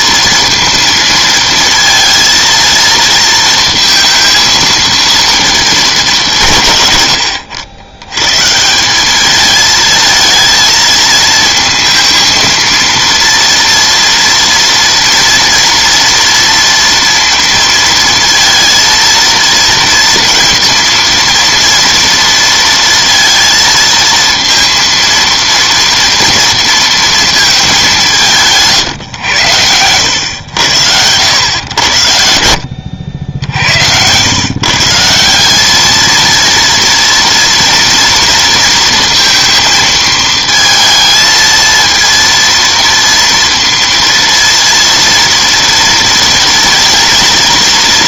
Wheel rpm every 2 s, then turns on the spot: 230, 230, 230, 160, 150, 220, 230, 240, 230, 230, 230, 230, 230, 230, 160, 90, 80, 130, 230, 230, 220, 230, 230, 230.
none